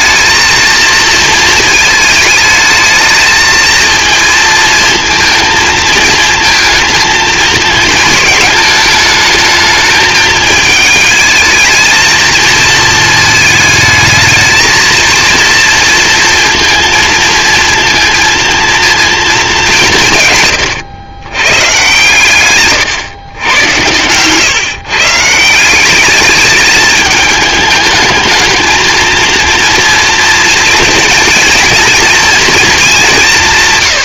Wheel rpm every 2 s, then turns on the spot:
230, 220, 230, 220, 220, 220, 230, 230, 230, 230, 120, 130, 140, 210, 220, 230, 220.
22-24